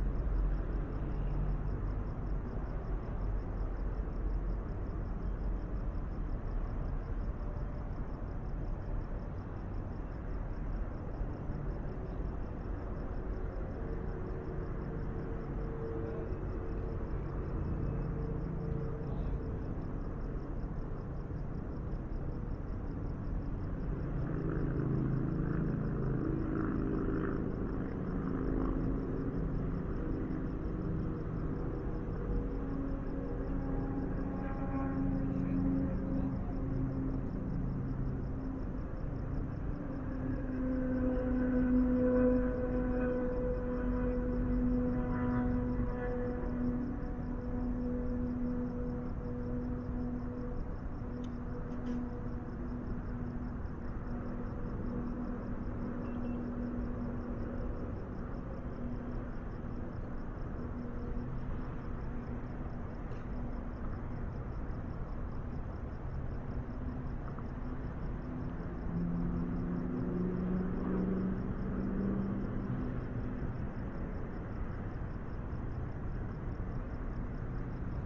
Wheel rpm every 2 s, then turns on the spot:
0, 0, 0, 0, 0, 0, 0, 0, 0, 0, 0, 0, 0, 0, 0, 0, 0, 0, 0, 0, 0, 0, 0, 0, 0, 0, 0, 0, 0, 0, 0, 0, 0, 0, 0, 0, 0, 0, 0.
none